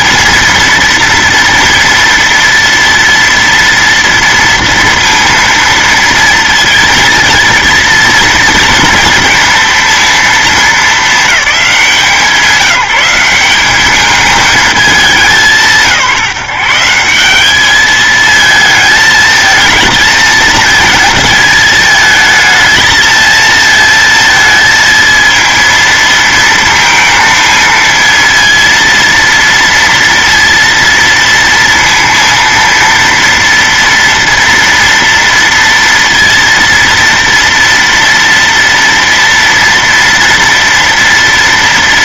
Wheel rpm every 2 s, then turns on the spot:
240, 230, 230, 230, 230, 220, 180, 210, 150, 220, 220, 220, 220, 230, 230, 230, 230, 230, 230, 230, 230.
none